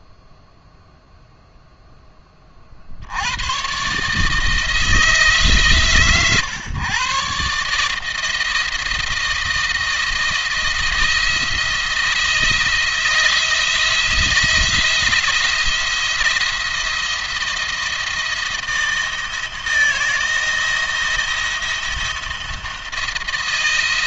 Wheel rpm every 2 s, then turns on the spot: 0, 40, 160, 120, 160, 160, 160, 170, 170, 170, 170, 170.
none